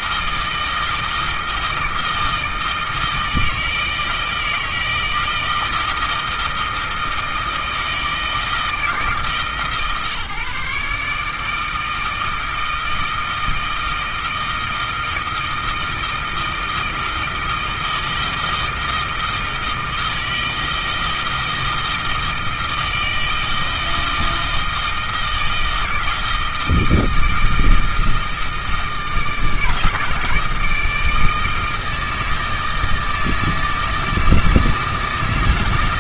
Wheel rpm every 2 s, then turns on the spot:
160, 160, 160, 160, 160, 150, 160, 160, 160, 160, 160, 160, 160, 160, 160, 150, 160, 160.
none